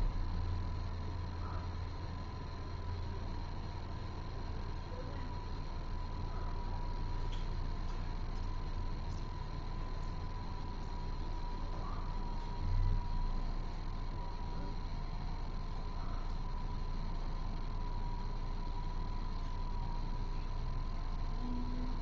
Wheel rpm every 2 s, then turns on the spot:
0, 0, 0, 0, 0, 0, 0, 0, 0, 0, 0.
none